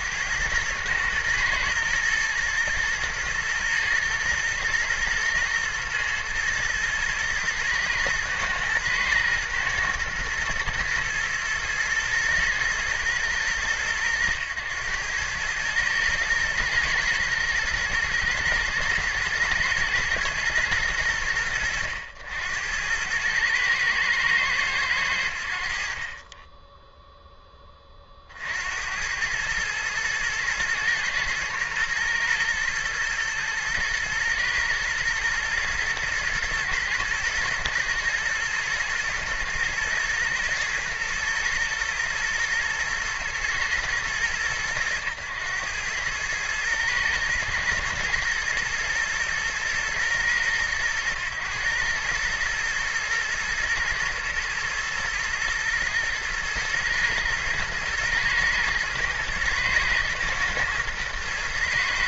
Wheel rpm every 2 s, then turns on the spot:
100, 110, 120, 110, 120, 110, 110, 100, 110, 110, 100, 90, 110, 10, 80, 110, 110, 120, 120, 110, 110, 110, 110, 110, 110, 110, 120, 120, 120, 120, 120.
none